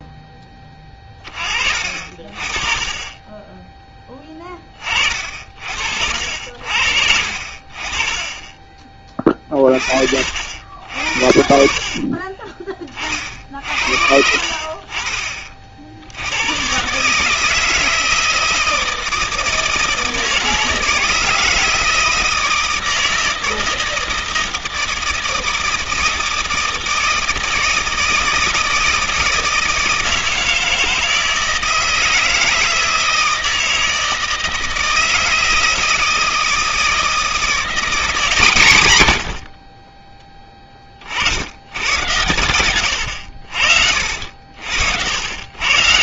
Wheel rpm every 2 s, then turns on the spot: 10, 40, 20, 60, 20, 70, 30, 60, 100, 160, 160, 160, 160, 160, 160, 160, 160, 160, 160, 150, 20, 90, 70.
12-14 42-44